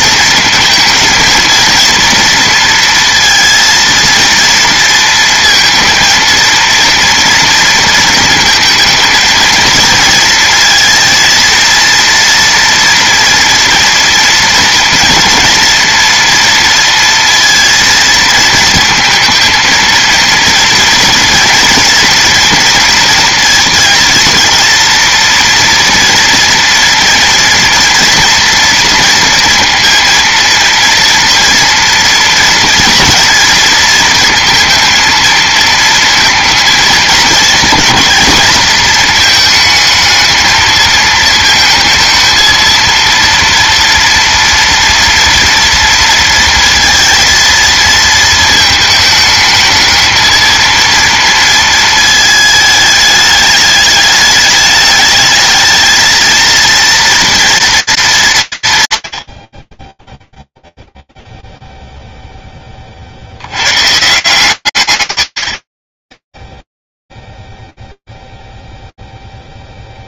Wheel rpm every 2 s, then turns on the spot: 220, 230, 230, 230, 220, 230, 230, 230, 230, 230, 230, 230, 230, 230, 230, 230, 230, 220, 220, 220, 220, 230, 240, 230, 220, 230, 220, 210, 230, 150, 0, 10, 140, 0, 0.
none